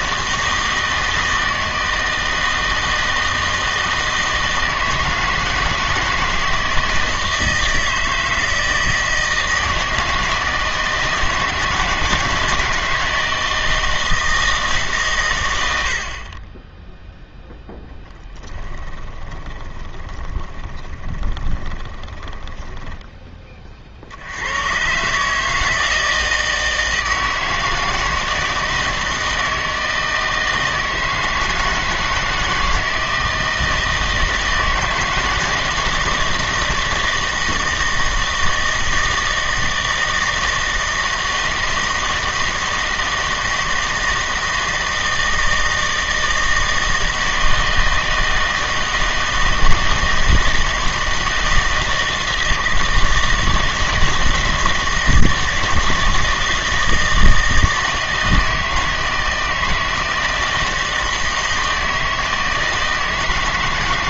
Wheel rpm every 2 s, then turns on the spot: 160, 160, 160, 160, 160, 160, 160, 150, 10, 10, 20, 10, 110, 160, 160, 160, 160, 160, 170, 160, 160, 160, 160, 160, 160, 160, 160, 160, 160, 160, 160, 160.
18-24